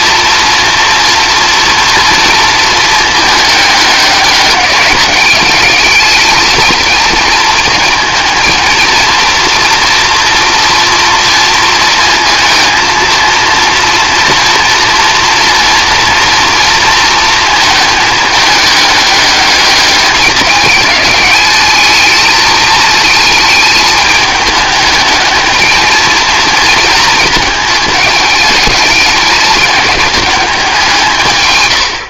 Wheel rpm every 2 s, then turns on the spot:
230, 220, 200, 220, 230, 230, 230, 230, 230, 210, 210, 220, 210, 220, 210, 190.
none